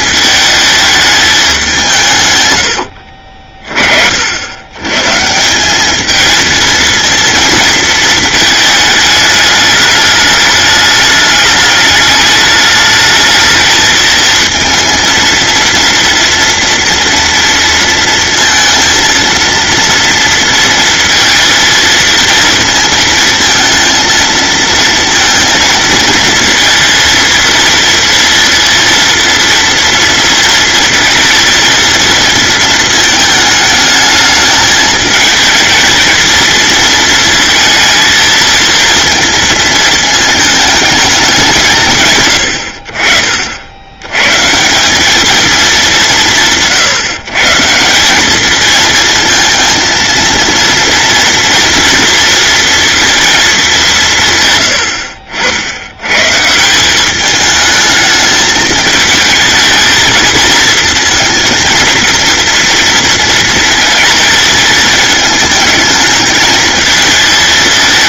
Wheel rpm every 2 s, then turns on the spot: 220, 90, 110, 230, 210, 210, 210, 230, 230, 230, 230, 220, 220, 230, 230, 230, 230, 220, 220, 230, 220, 70, 180, 160, 220, 230, 230, 110, 170, 220, 230, 230, 220, 220.
none